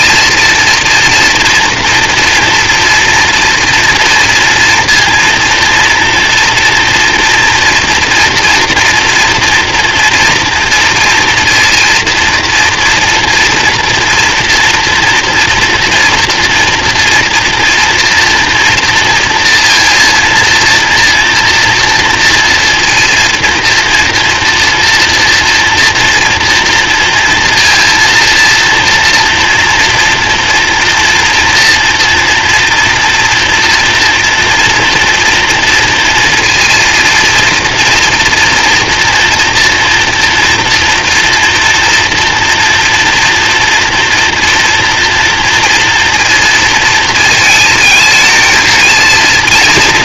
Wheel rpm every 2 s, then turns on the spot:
230, 240, 230, 230, 240, 230, 230, 230, 230, 230, 230, 230, 230, 240, 230, 240, 230, 230, 230, 230, 230, 230, 230, 230, 230.
none